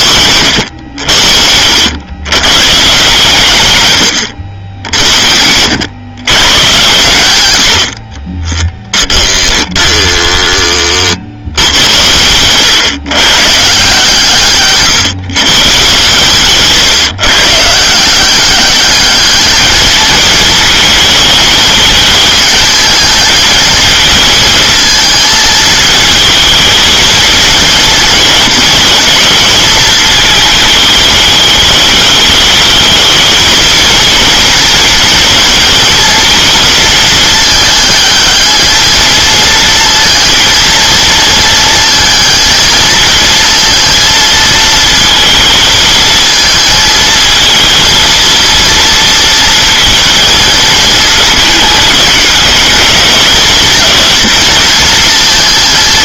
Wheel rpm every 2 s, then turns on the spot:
100, 140, 70, 120, 10, 20, 110, 130, 140, 200, 220, 220, 220, 220, 220, 220, 220, 230, 230, 220, 230, 220, 230, 220, 230, 220, 200, 220.
8-10